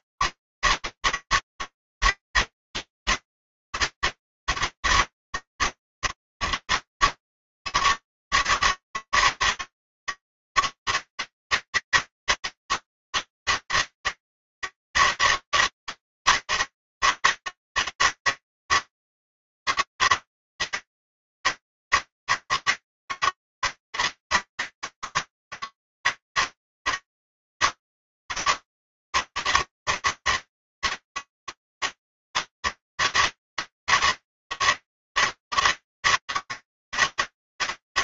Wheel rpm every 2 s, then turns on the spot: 150, 160, 150, 120, 160, 160, 160, 160, 160, 160, 160, 160, 160, 160, 160, 150, 160, 160, 160.
none